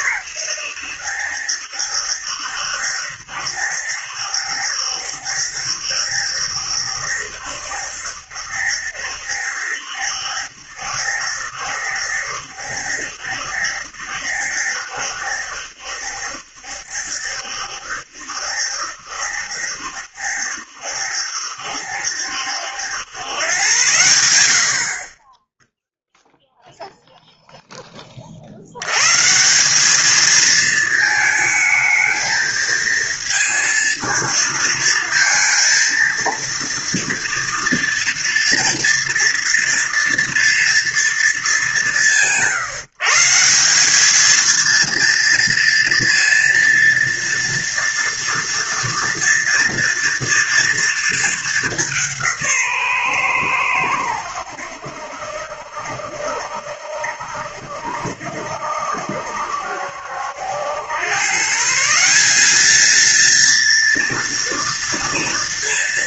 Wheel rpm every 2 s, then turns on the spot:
110, 70, 70, 70, 70, 70, 70, 70, 70, 70, 70, 80, 70, 0, 60, 220, 220, 230, 230, 230, 230, 160, 220, 230, 230, 230, 160, 80, 70, 60, 80, 200, 230.
none